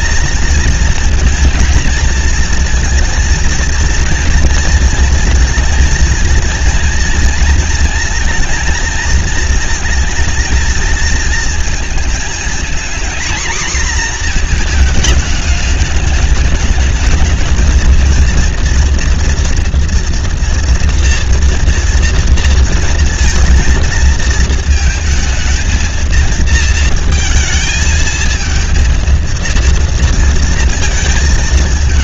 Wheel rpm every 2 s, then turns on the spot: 230, 230, 230, 230, 230, 230, 230, 240, 210, 230, 230, 230, 220, 230, 220, 230.
none